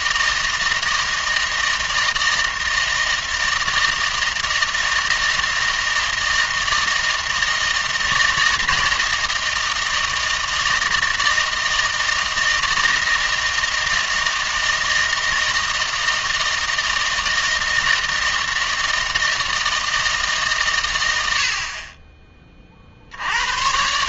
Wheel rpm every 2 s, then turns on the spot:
160, 160, 160, 160, 160, 160, 160, 160, 160, 160, 130, 40.
none